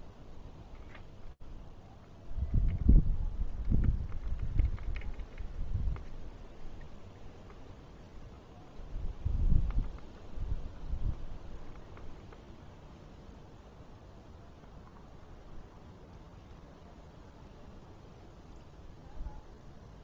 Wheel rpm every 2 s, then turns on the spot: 0, 0, 0, 0, 0, 0, 0, 0, 0, 0.
none